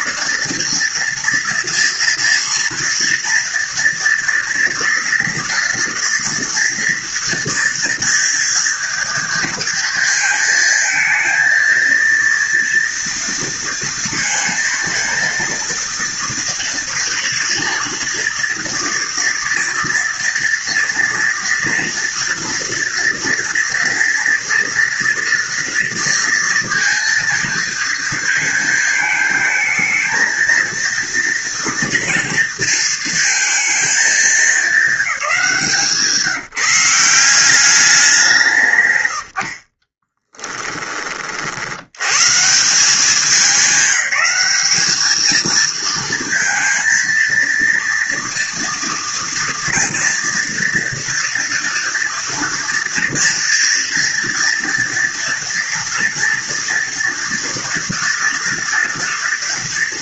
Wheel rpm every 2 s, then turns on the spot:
230, 230, 240, 230, 230, 220, 230, 230, 230, 240, 230, 230, 230, 230, 220, 230, 230, 210, 180, 120, 30, 180, 210, 230, 230, 230, 230, 230, 230, 230.
none